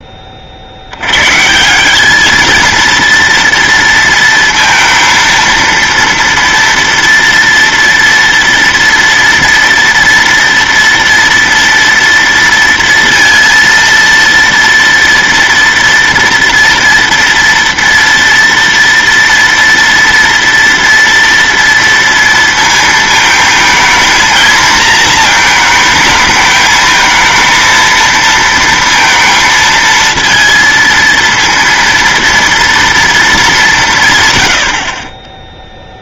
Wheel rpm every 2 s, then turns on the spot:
70, 230, 230, 230, 230, 240, 230, 230, 230, 230, 230, 220, 230, 220, 230, 230, 230, 140.
none